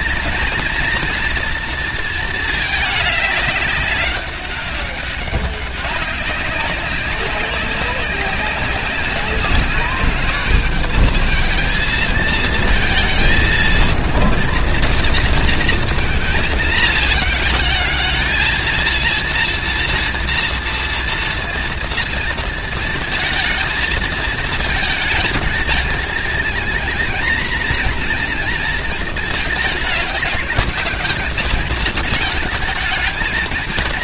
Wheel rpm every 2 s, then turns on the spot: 230, 210, 200, 190, 200, 210, 220, 230, 230, 220, 230, 230, 220, 230, 240, 200, 210.
none